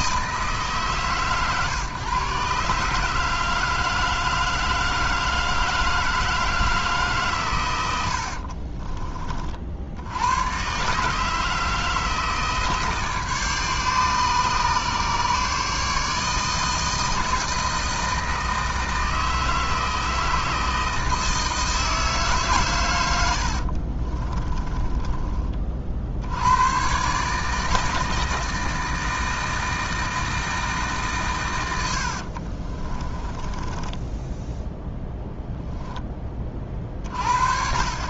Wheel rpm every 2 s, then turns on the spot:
150, 150, 160, 160, 40, 130, 150, 140, 160, 160, 160, 120, 20, 120, 160, 150, 30, 0, 40.
8-10 24-26 32-34